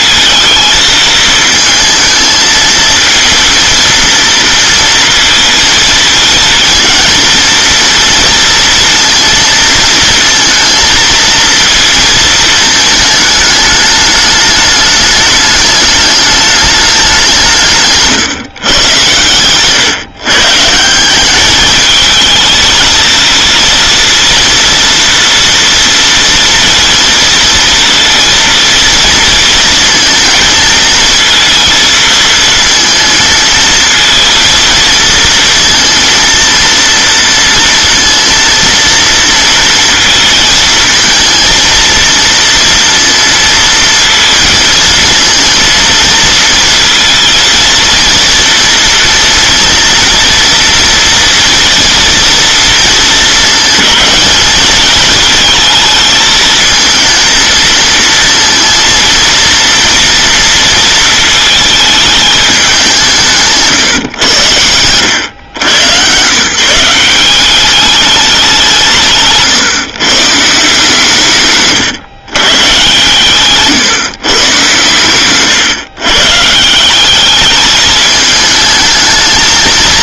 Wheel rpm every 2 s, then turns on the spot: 220, 230, 230, 230, 230, 230, 220, 210, 210, 130, 160, 220, 230, 230, 230, 220, 230, 230, 230, 230, 220, 230, 230, 230, 230, 230, 230, 220, 220, 230, 230, 190, 100, 150, 180, 150, 130, 130, 170, 220.
none